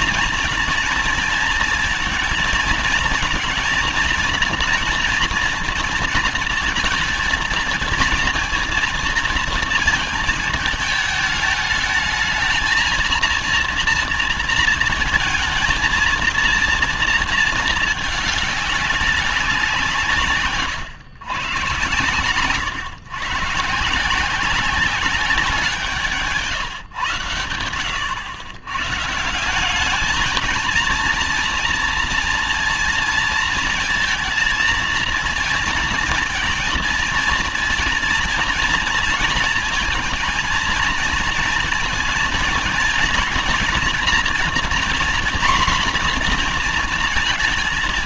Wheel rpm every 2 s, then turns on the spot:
240, 220, 230, 230, 230, 220, 220, 230, 230, 210, 140, 120, 180, 140, 120, 220, 230, 230, 230, 230, 230, 230, 240, 240.
none